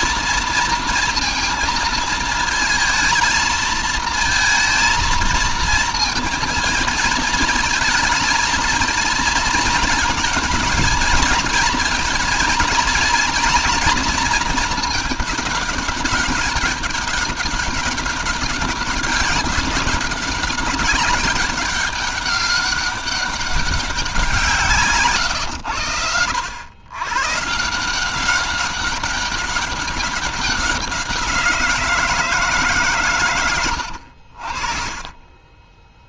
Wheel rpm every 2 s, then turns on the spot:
230, 220, 230, 230, 220, 220, 230, 220, 200, 190, 190, 190, 150, 100, 200, 190, 140, 50.
none